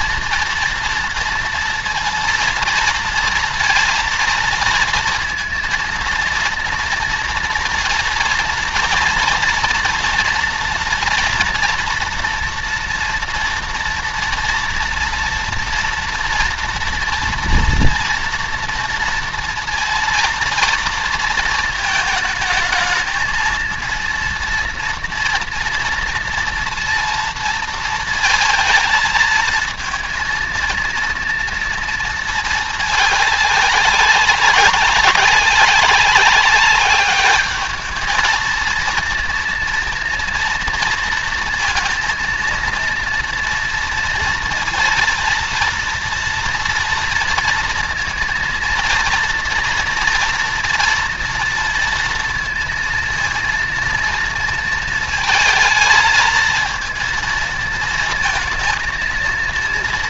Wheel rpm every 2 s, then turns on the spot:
230, 230, 230, 230, 230, 240, 230, 240, 230, 230, 230, 220, 230, 230, 220, 230, 200, 190, 200, 230, 230, 230, 230, 230, 230, 230, 230, 230, 230, 230.
none